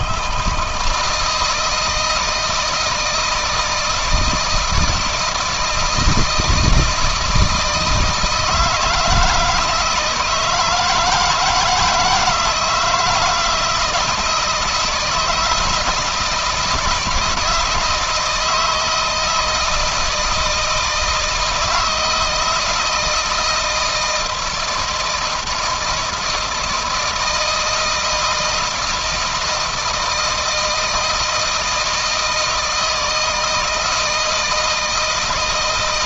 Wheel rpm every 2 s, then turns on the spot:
160, 160, 160, 160, 160, 160, 160, 170, 160, 160, 160, 160, 160, 160, 160, 160, 160, 160.
none